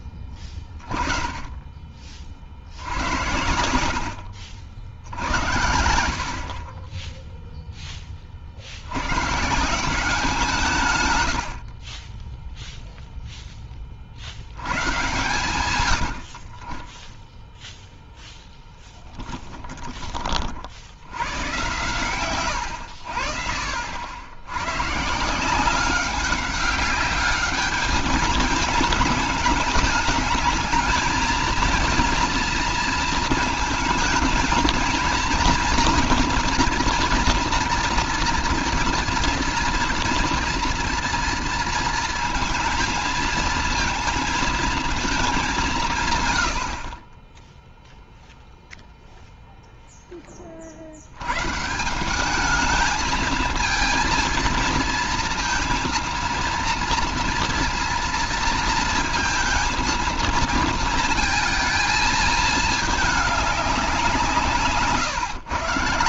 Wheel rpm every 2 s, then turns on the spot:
20, 80, 80, 10, 160, 50, 10, 110, 0, 20, 120, 60, 180, 210, 210, 230, 230, 230, 230, 230, 230, 230, 200, 20, 0, 80, 220, 230, 230, 230, 230, 210, 140.
none